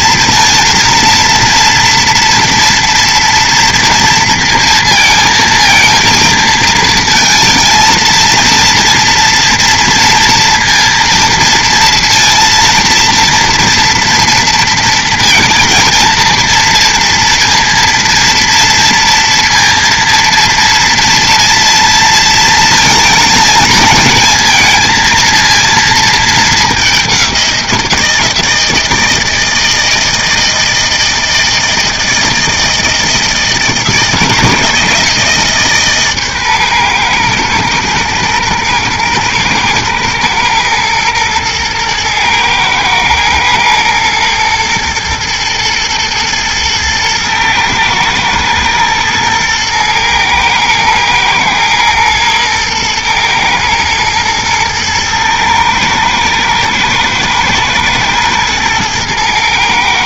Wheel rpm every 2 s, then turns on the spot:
230, 230, 230, 230, 230, 230, 230, 230, 230, 230, 230, 220, 220, 200, 160, 160, 160, 160, 120, 120, 110, 110, 120, 110, 110, 110, 110, 110, 110, 110.
none